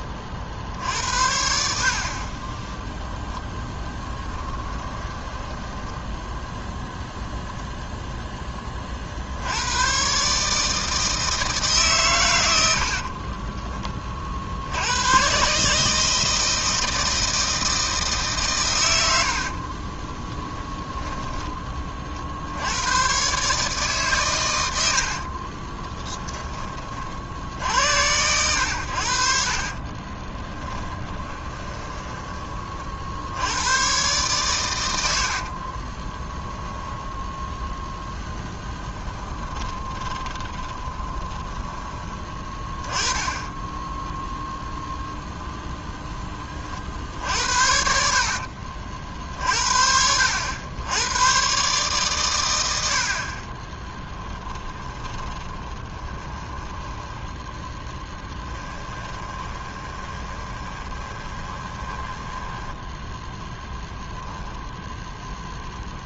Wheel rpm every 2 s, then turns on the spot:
30, 10, 10, 10, 10, 150, 90, 60, 160, 120, 10, 70, 110, 20, 90, 20, 30, 110, 10, 10, 20, 20, 0, 30, 50, 80, 90, 10, 20, 10, 20, 10, 10.
4-6 20-22 30-32 36-38 40-42 54-64